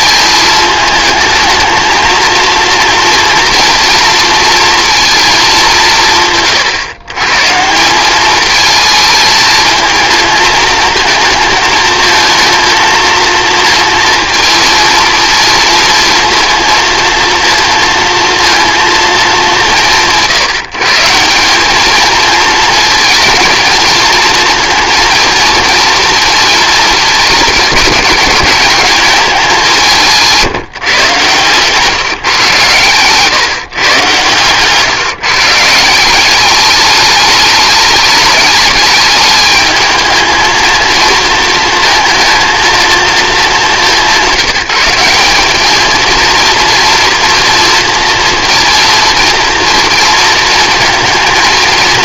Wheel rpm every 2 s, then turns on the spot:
220, 230, 220, 140, 220, 220, 230, 230, 230, 210, 170, 230, 230, 220, 210, 130, 120, 140, 210, 210, 230, 220, 190, 230, 230, 220.
none